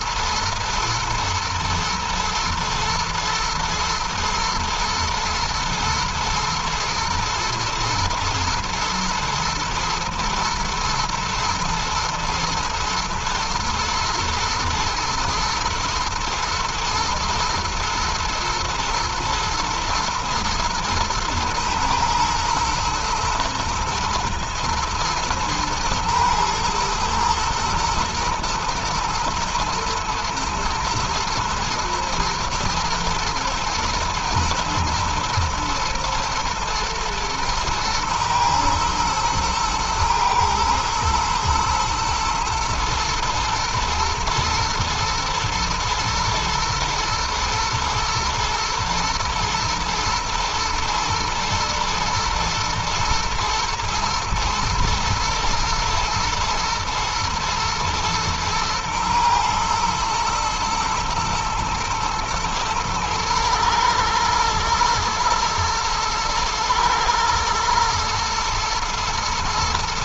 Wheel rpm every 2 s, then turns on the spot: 120, 110, 110, 120, 120, 110, 110, 110, 120, 120, 110, 120, 120, 110, 110, 120, 110, 120, 110, 120, 110, 120, 120, 120, 120, 120, 120, 120, 110, 110, 110, 110, 120, 120, 120.
none